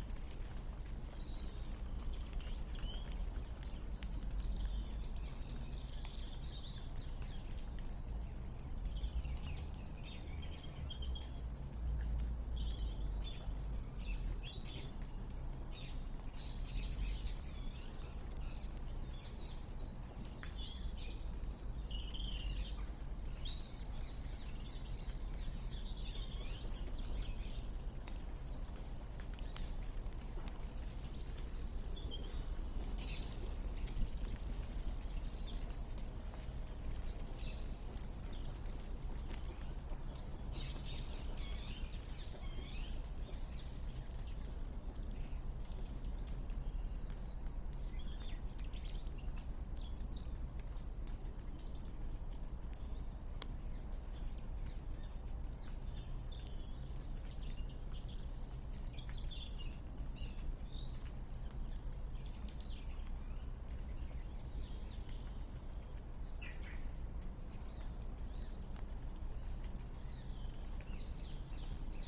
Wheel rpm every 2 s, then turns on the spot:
0, 0, 0, 0, 0, 0, 0, 0, 0, 0, 0, 0, 0, 0, 0, 0, 0, 0, 0, 0, 0, 0, 0, 0, 0, 0, 0, 0, 0, 0, 0, 0, 0, 0, 0, 0.
none